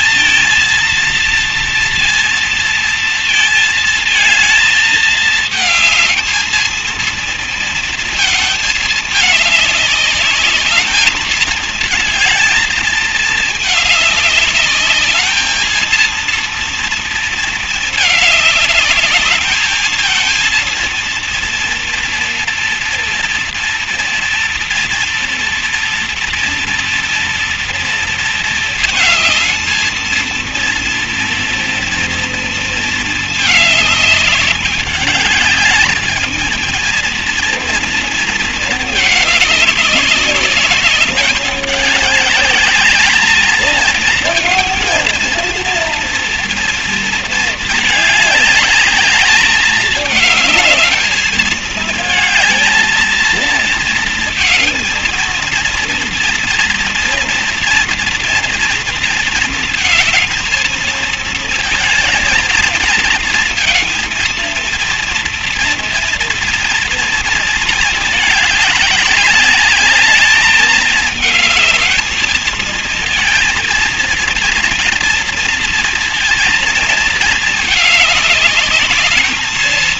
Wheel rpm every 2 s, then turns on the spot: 230, 230, 220, 230, 210, 220, 220, 210, 230, 210, 230, 230, 230, 230, 220, 230, 220, 210, 230, 220, 210, 220, 230, 230, 210, 220, 230, 230, 240, 230, 220, 230, 230, 230, 210, 210, 230, 230, 230, 220.
none